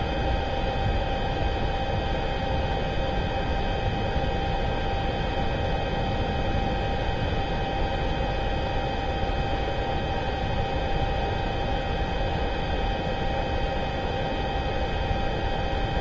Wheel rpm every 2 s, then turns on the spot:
0, 0, 0, 0, 0, 0, 0, 0.
none